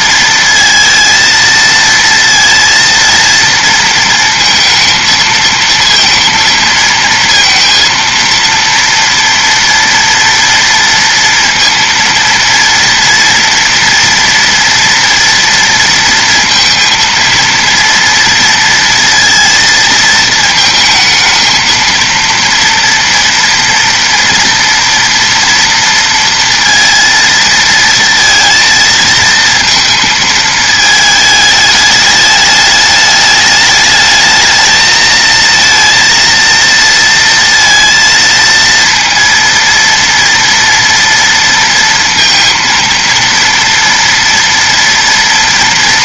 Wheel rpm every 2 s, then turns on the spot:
230, 230, 230, 230, 230, 230, 230, 240, 230, 230, 220, 230, 230, 230, 230, 220, 210, 220, 230, 230, 230, 230, 230.
none